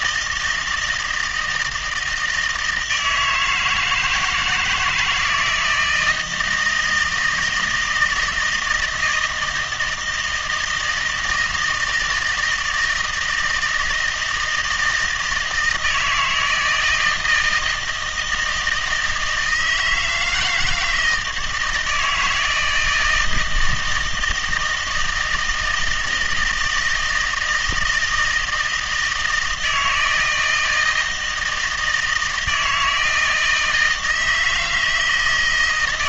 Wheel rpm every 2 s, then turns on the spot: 160, 160, 160, 160, 160, 160, 160, 160, 160, 170, 160, 160, 160, 160, 160, 160, 160, 160.
none